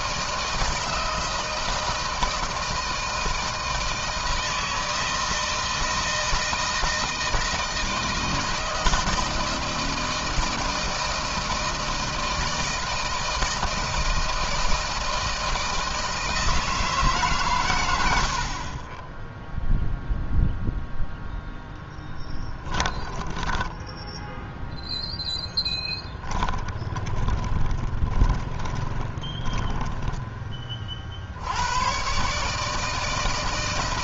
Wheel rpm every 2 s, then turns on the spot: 160, 160, 160, 160, 160, 160, 160, 160, 160, 30, 0, 10, 0, 30, 20, 40, 160.
22-24 26-30